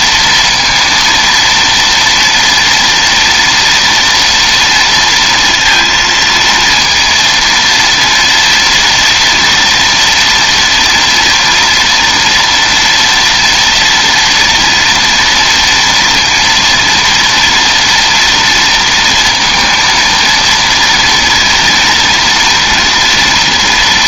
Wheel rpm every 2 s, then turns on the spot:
230, 230, 230, 230, 230, 240, 230, 240, 230, 230, 230, 230.
none